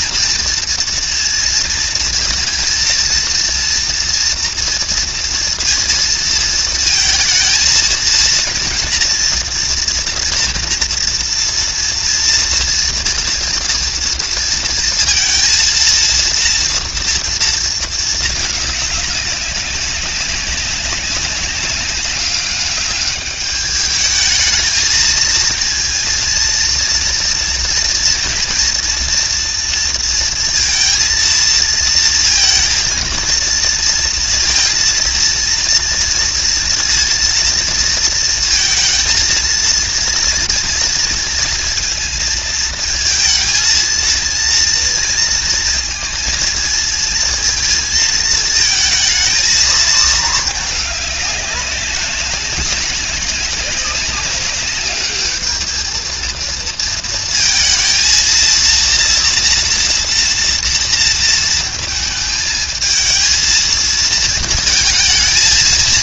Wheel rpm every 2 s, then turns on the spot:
230, 230, 230, 230, 240, 230, 230, 230, 230, 200, 190, 200, 230, 230, 230, 230, 230, 230, 230, 230, 230, 220, 230, 220, 220, 210, 190, 210, 220, 230, 230, 220, 230.
none